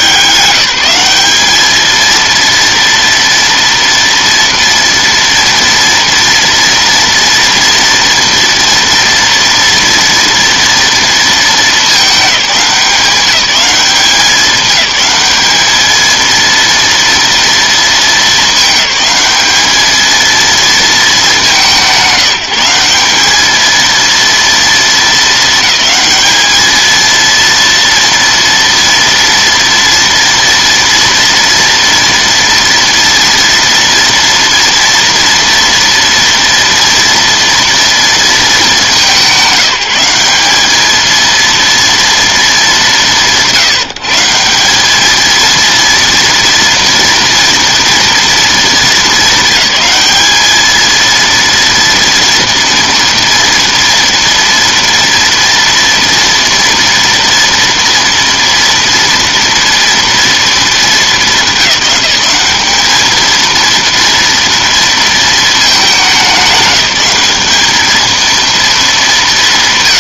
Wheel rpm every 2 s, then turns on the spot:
190, 230, 230, 230, 230, 230, 190, 200, 230, 210, 220, 190, 220, 220, 230, 230, 230, 240, 230, 210, 210, 200, 190, 230, 230, 220, 240, 230, 230, 230, 220, 210, 230, 200, 220.
none